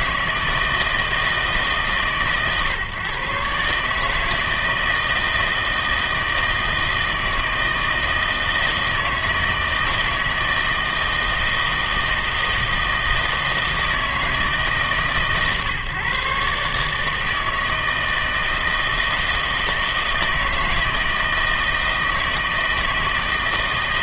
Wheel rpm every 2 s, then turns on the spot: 160, 140, 160, 160, 160, 160, 160, 160, 150, 160, 160, 160.
none